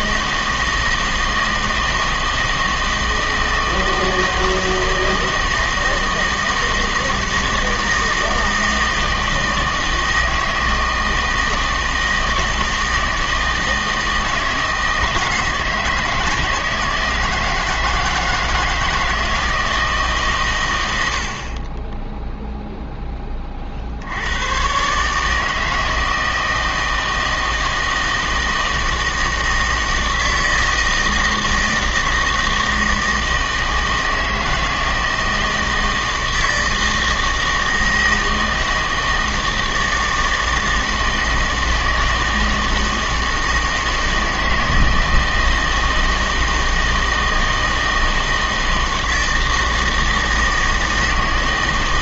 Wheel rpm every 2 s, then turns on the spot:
160, 160, 160, 160, 160, 160, 160, 160, 160, 160, 100, 0, 130, 160, 160, 160, 160, 160, 160, 160, 160, 160, 160, 160, 160, 160.
none